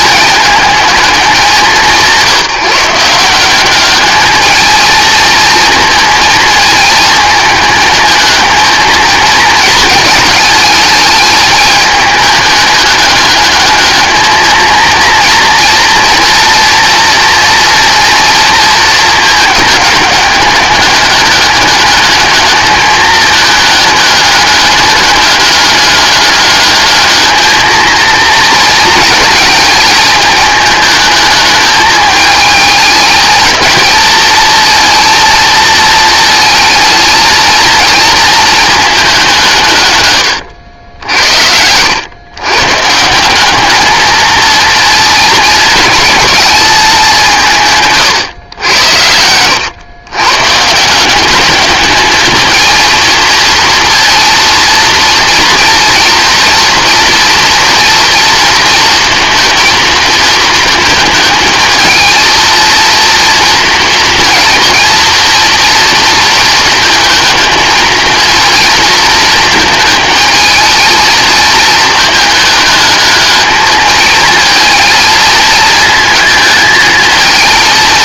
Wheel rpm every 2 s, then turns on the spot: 210, 170, 230, 220, 220, 220, 210, 230, 230, 220, 200, 210, 210, 210, 220, 220, 220, 230, 230, 210, 80, 150, 220, 190, 90, 170, 230, 230, 230, 230, 220, 230, 230, 230, 230, 220, 210, 220, 220.
none